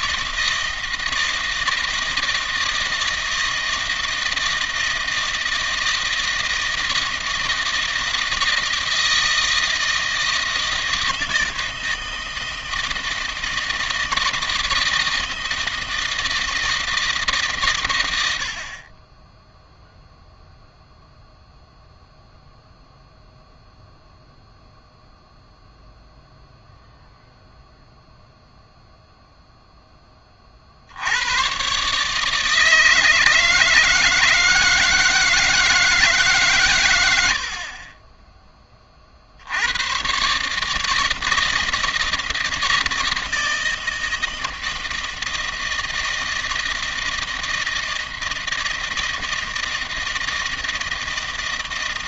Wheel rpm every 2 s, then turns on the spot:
160, 160, 160, 160, 160, 160, 160, 160, 160, 30, 0, 0, 0, 0, 0, 70, 160, 160, 90, 40, 160, 170, 160, 160, 160, 160.
none